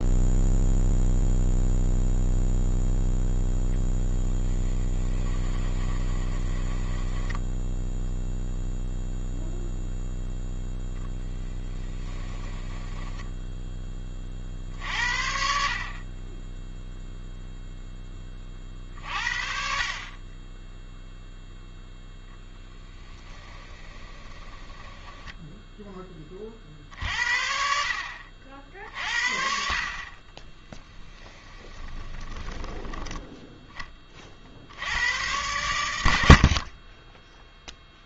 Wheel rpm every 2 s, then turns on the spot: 0, 0, 20, 10, 0, 0, 10, 60, 0, 40, 10, 10, 10, 50, 50, 10, 10, 80, 30.
4-8 12-14 22-26 30-34